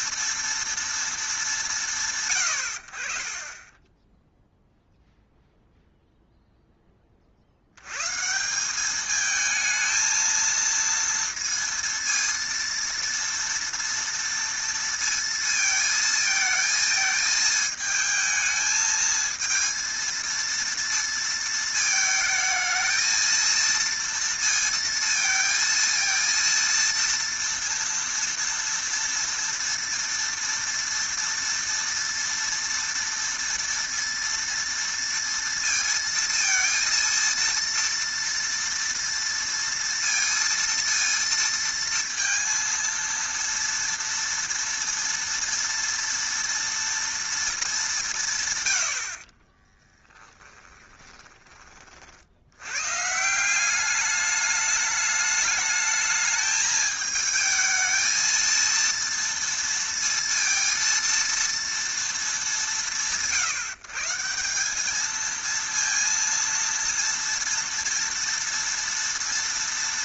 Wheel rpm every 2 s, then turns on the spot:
230, 100, 0, 10, 190, 230, 230, 230, 220, 220, 230, 220, 230, 230, 230, 230, 230, 230, 230, 230, 230, 230, 230, 230, 110, 10, 100, 210, 210, 230, 230, 160, 190, 230, 230.
50-52